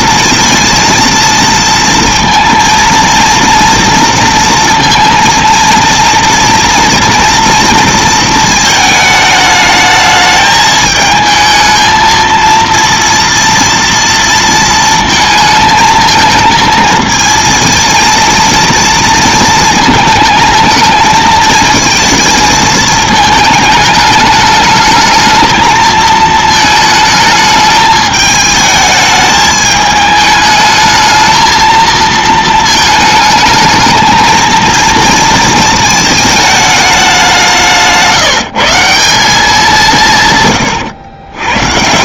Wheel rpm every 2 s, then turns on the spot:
230, 230, 230, 240, 220, 220, 230, 230, 220, 230, 220, 220, 210, 220, 220, 210, 220, 230, 210, 160, 120.
none